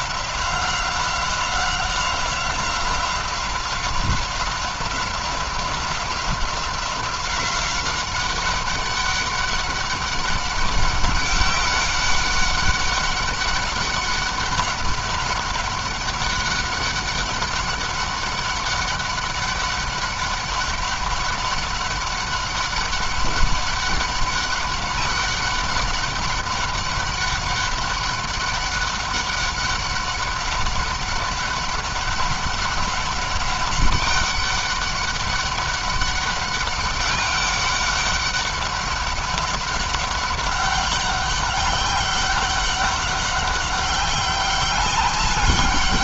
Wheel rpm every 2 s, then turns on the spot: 190, 180, 180, 180, 190, 200, 200, 200, 200, 190, 200, 200, 200, 200, 200, 190, 200, 200, 200, 190, 200, 190, 200.
none